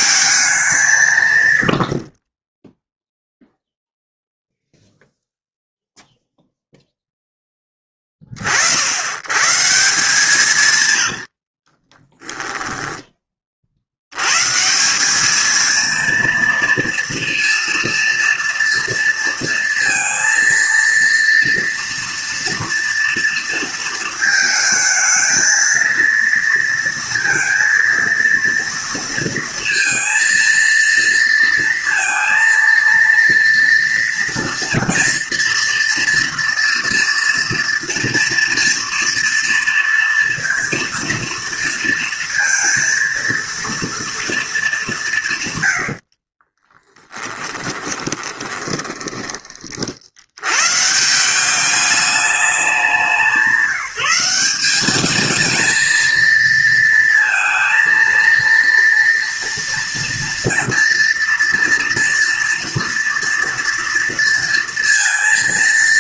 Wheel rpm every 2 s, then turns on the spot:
180, 0, 0, 0, 70, 110, 10, 160, 230, 230, 230, 230, 220, 230, 230, 230, 230, 230, 230, 230, 230, 230, 200, 20, 20, 140, 180, 200, 230, 230, 230, 230, 230.
10-12 46-50